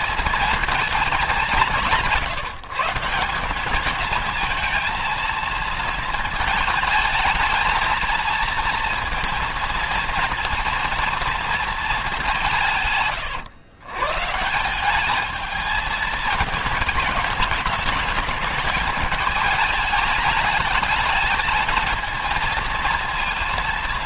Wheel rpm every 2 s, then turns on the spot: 220, 160, 220, 220, 230, 230, 160, 190, 210, 210, 210, 230.
none